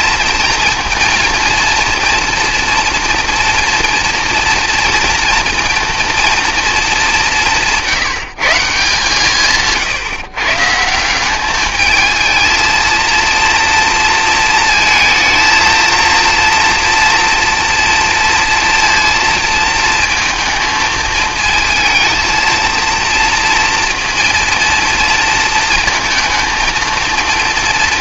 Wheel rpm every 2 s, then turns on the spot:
230, 230, 230, 210, 160, 160, 230, 230, 230, 230, 220, 230, 230, 230.
none